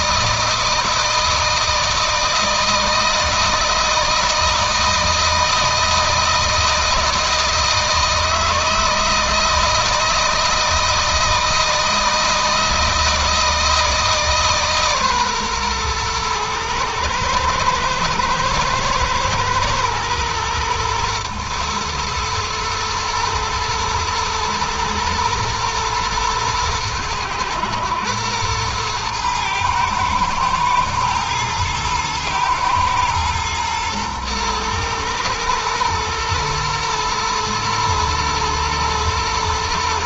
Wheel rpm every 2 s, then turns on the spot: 160, 160, 160, 160, 160, 160, 160, 140, 110, 110, 110, 110, 110, 110, 110, 110, 110, 110, 120, 110.
none